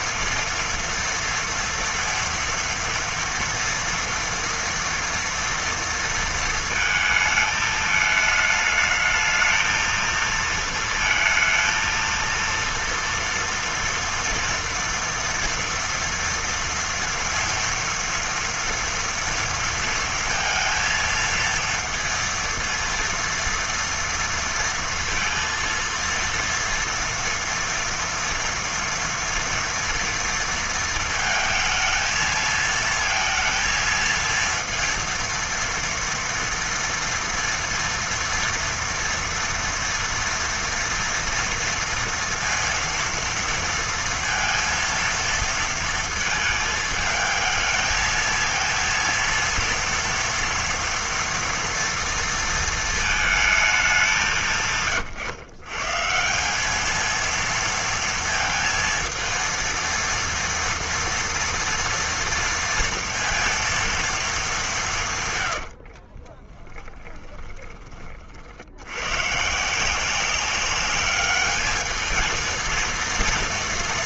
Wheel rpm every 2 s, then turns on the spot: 230, 230, 230, 230, 220, 230, 230, 230, 230, 230, 230, 230, 230, 230, 230, 230, 220, 230, 230, 230, 230, 230, 230, 220, 230, 230, 230, 150, 200, 230, 230, 230, 190, 10, 80, 200, 220.
66-68